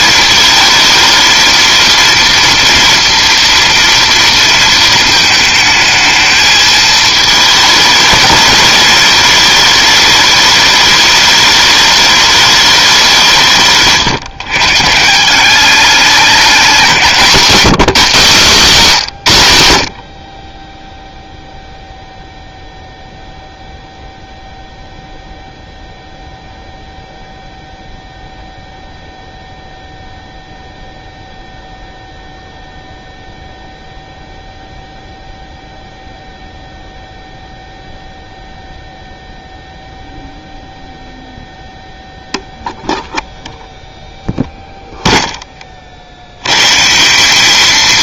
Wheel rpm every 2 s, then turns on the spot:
220, 230, 230, 220, 210, 210, 200, 150, 180, 170, 20, 0, 0, 0, 0, 0, 0, 0, 0, 0, 0, 0, 0, 140.
none